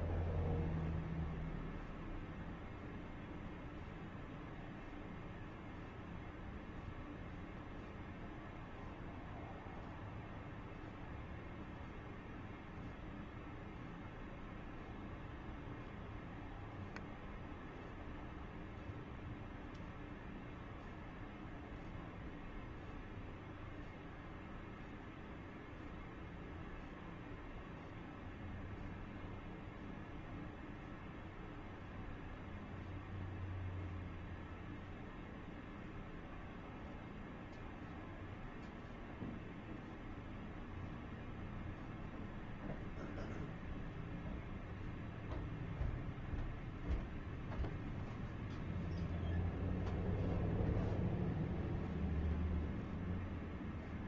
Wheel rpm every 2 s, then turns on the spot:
0, 0, 0, 0, 0, 0, 0, 0, 0, 0, 0, 0, 0, 0, 0, 0, 0, 0, 0, 0, 0, 0, 0, 0, 0, 0, 0.
none